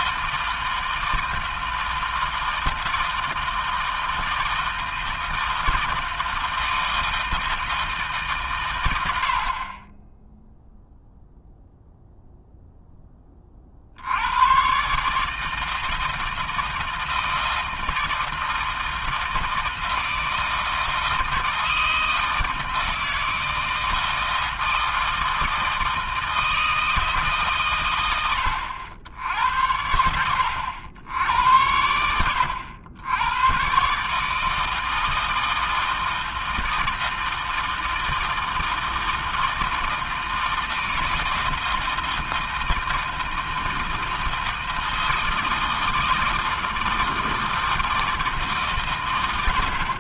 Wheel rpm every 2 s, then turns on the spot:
160, 160, 160, 160, 140, 0, 0, 100, 160, 160, 160, 160, 160, 160, 90, 80, 90, 160, 160, 160, 160, 160, 160, 160, 160.
none